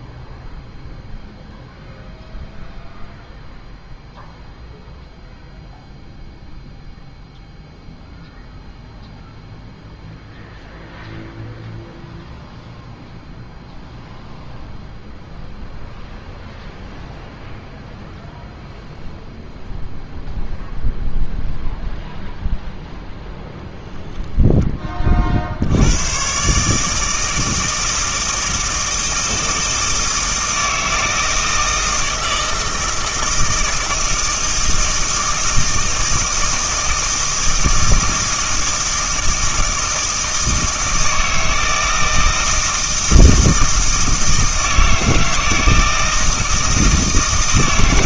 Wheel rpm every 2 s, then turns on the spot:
0, 0, 0, 0, 0, 0, 0, 0, 0, 0, 0, 0, 10, 140, 160, 160, 160, 160, 160, 160, 160, 160, 160, 160.
none